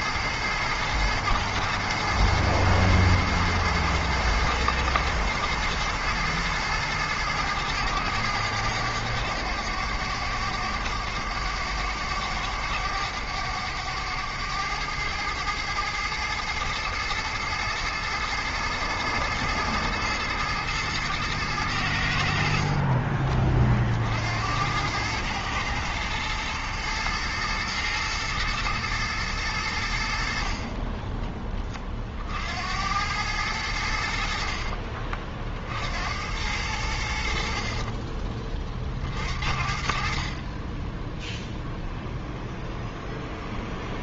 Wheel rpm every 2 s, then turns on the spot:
110, 110, 110, 110, 100, 100, 100, 110, 110, 110, 110, 30, 110, 110, 110, 20, 100, 40, 80, 40, 10, 0.
none